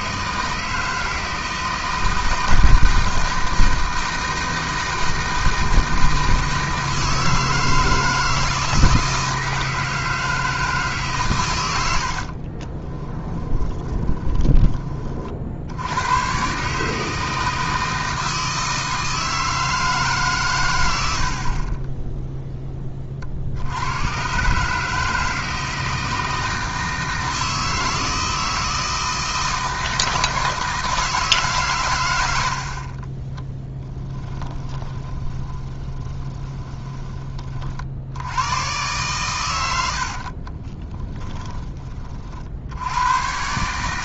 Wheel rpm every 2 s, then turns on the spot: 160, 160, 160, 160, 160, 160, 40, 20, 140, 160, 120, 10, 130, 160, 160, 160, 70, 10, 20, 100, 40, 70.
12-16 34-38 40-42